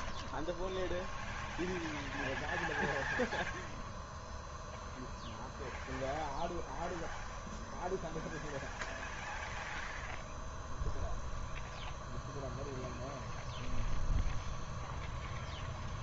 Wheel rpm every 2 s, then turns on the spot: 0, 0, 0, 0, 0, 0, 0, 0.
none